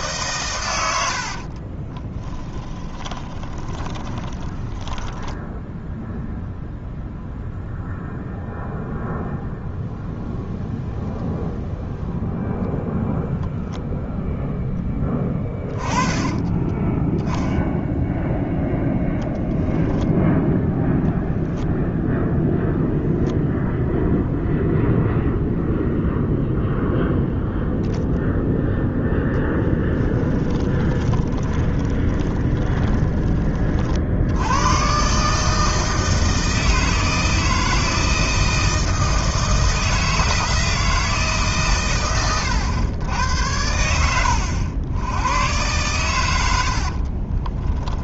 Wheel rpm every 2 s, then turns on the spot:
110, 20, 10, 0, 0, 0, 0, 0, 10, 0, 0, 0, 0, 0, 10, 20, 20, 110, 160, 160, 160, 110, 90, 60.
2-6 16-18 30-34 46-48